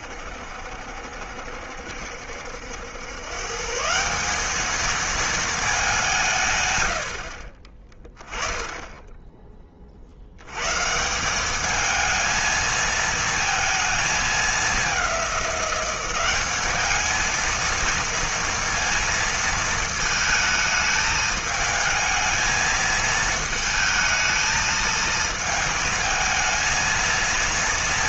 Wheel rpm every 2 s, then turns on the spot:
70, 160, 190, 20, 60, 220, 220, 200, 230, 220, 220, 220, 220, 180.
none